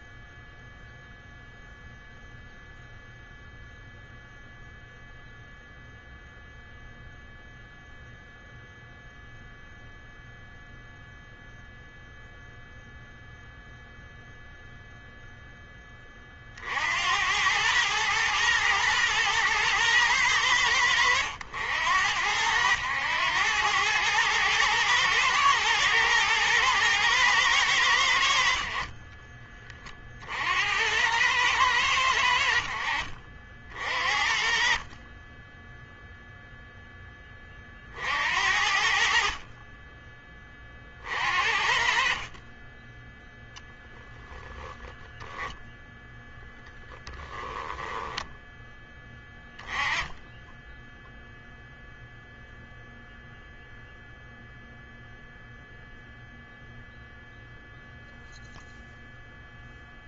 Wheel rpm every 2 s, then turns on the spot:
0, 0, 0, 0, 0, 0, 0, 0, 60, 110, 80, 90, 110, 110, 50, 80, 60, 30, 0, 60, 40, 10, 10, 10, 10, 10, 0, 0, 0, 0.
42-44 46-48